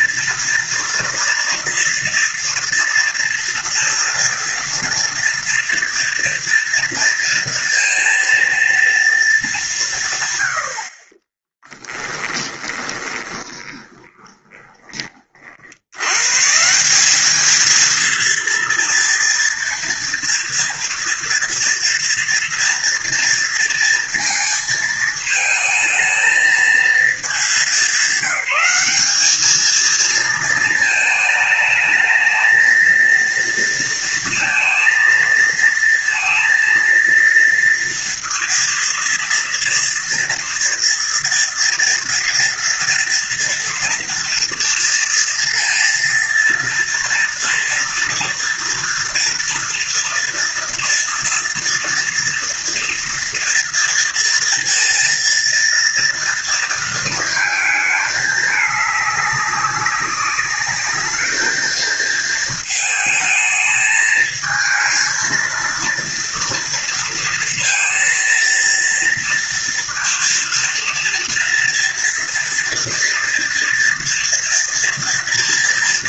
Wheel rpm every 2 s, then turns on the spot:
230, 240, 230, 230, 230, 100, 20, 20, 140, 230, 230, 230, 230, 220, 210, 220, 220, 230, 230, 230, 230, 230, 230, 230, 230, 240, 230, 230, 230, 210, 200, 220, 220, 230, 230, 230, 230, 230.
12-16